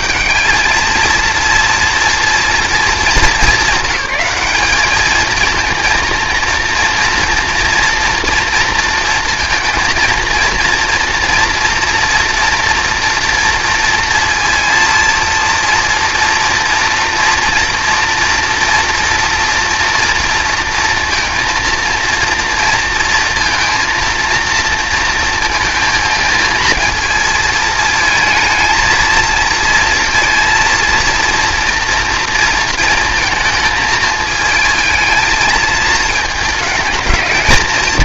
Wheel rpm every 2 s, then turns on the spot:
210, 230, 210, 230, 230, 230, 240, 230, 230, 230, 230, 230, 230, 230, 220, 230, 230, 220, 220.
none